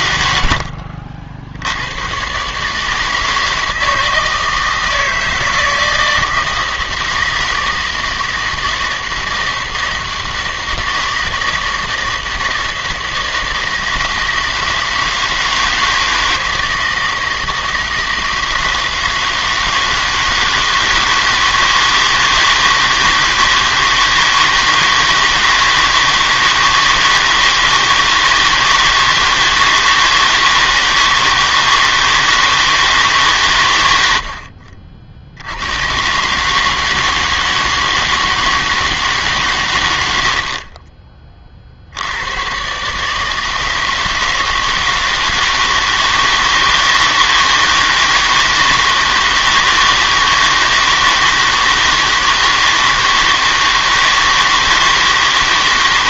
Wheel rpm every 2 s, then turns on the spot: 70, 150, 160, 160, 160, 160, 160, 160, 160, 160, 160, 160, 160, 160, 160, 160, 160, 50, 150, 160, 40, 130, 160, 160, 160, 160, 160, 160.
34-36 40-42